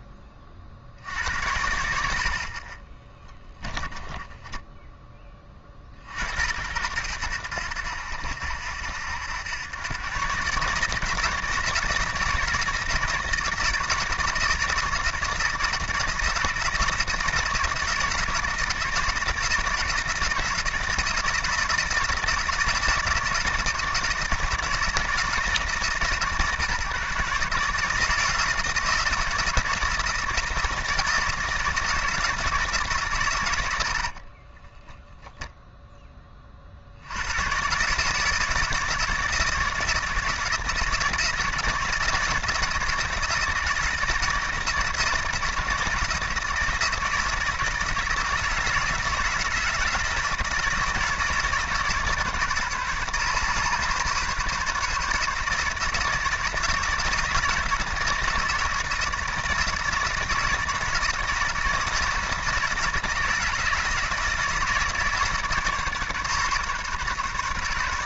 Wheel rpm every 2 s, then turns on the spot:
50, 40, 10, 80, 80, 150, 160, 160, 160, 160, 160, 160, 160, 130, 160, 160, 160, 20, 50, 160, 160, 160, 160, 160, 160, 160, 140, 150, 170, 160, 160, 160, 160, 140.
4-6 34-36